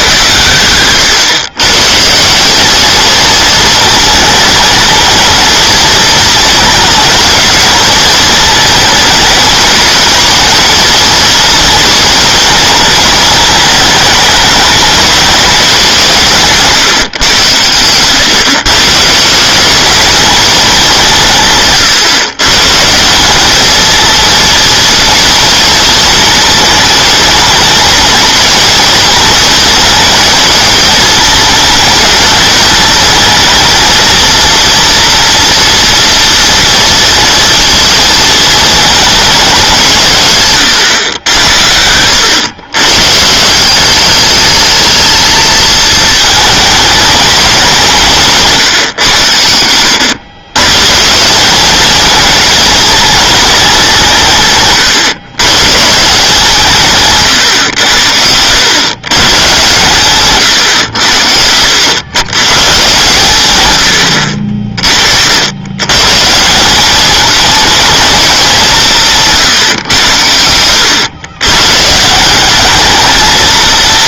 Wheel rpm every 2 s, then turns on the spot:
100, 210, 220, 220, 220, 220, 220, 210, 150, 140, 200, 150, 230, 230, 220, 220, 220, 230, 230, 220, 130, 110, 220, 220, 150, 130, 220, 140, 160, 100, 120, 120, 50, 180, 180, 90, 200.
none